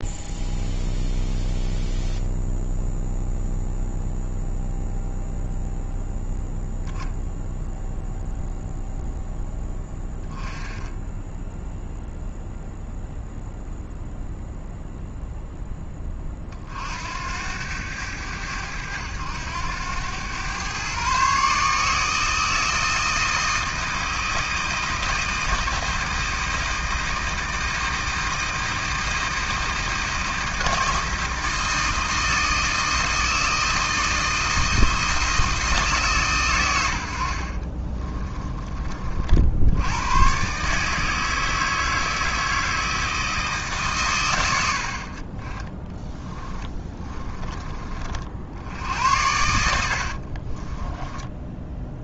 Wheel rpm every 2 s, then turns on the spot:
0, 0, 0, 0, 0, 10, 0, 0, 60, 90, 130, 160, 160, 160, 160, 160, 160, 160, 90, 30, 150, 160, 60, 20, 70, 20.
46-48 50-52